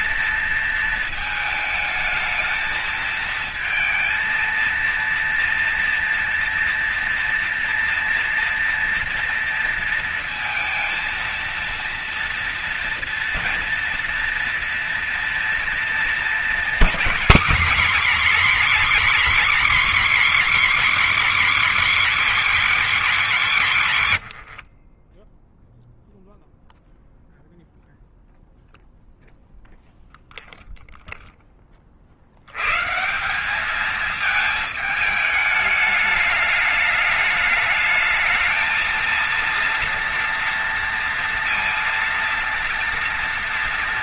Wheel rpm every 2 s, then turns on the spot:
230, 220, 230, 230, 230, 230, 230, 230, 230, 270, 290, 260, 100, 0, 0, 0, 80, 220, 210, 220, 230, 230.
24-26